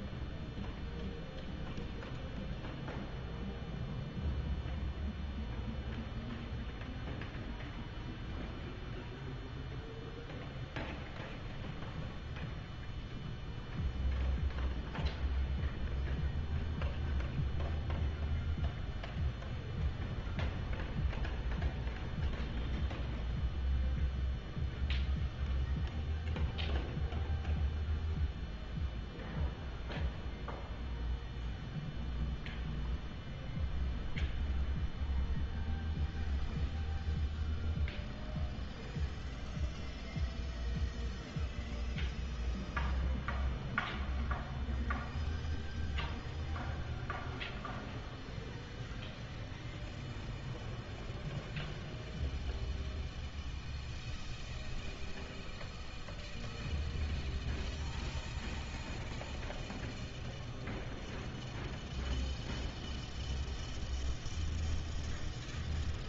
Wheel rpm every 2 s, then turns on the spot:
0, 0, 0, 0, 0, 0, 0, 0, 0, 0, 0, 0, 0, 0, 0, 0, 0, 0, 0, 0, 0, 0, 0, 0, 0, 0, 0, 0, 0, 0, 0, 0, 0.
none